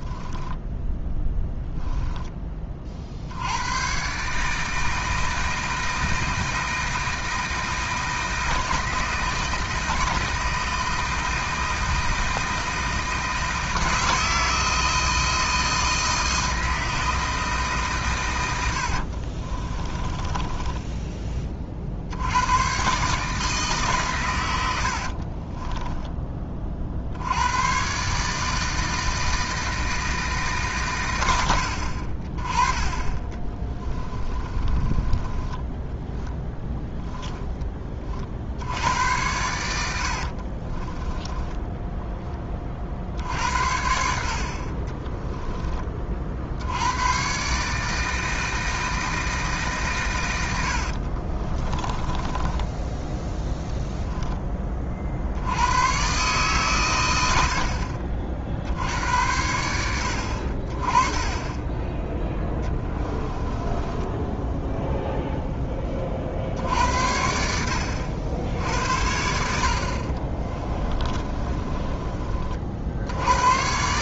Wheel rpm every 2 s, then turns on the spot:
10, 30, 150, 160, 160, 160, 160, 160, 160, 90, 20, 100, 100, 30, 160, 140, 30, 30, 10, 70, 30, 30, 40, 60, 160, 90, 10, 20, 130, 60, 50, 10, 0, 60, 70, 30, 40.
0-2 18-22 34-38 40-42 52-54 62-64 70-72